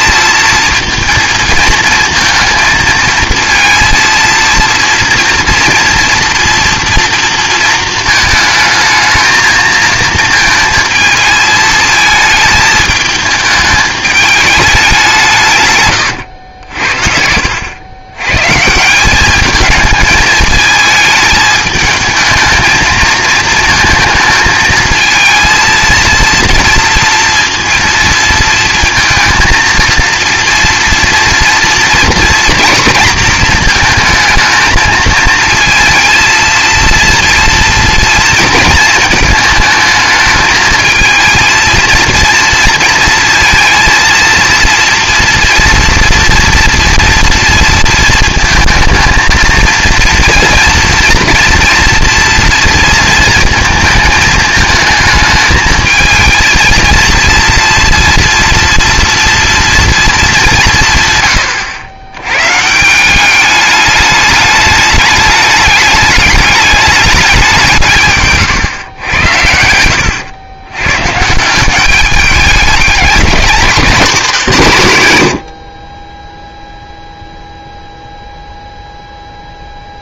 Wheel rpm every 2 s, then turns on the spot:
230, 220, 230, 230, 220, 230, 220, 200, 80, 160, 220, 220, 220, 230, 230, 230, 240, 220, 230, 230, 220, 230, 230, 230, 230, 230, 230, 220, 230, 230, 170, 150, 210, 210, 120, 110, 210, 150, 0, 0.
none